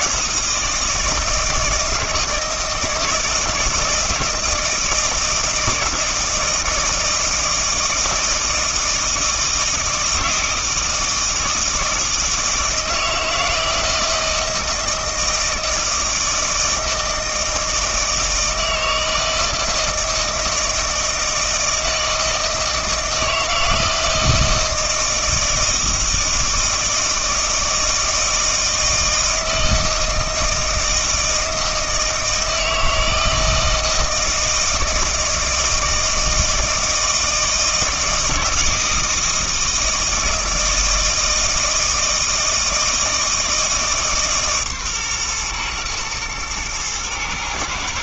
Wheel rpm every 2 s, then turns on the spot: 160, 160, 160, 160, 160, 160, 160, 160, 160, 160, 160, 160, 160, 160, 160, 160, 160, 160, 160, 170, 160, 160, 140, 110.
none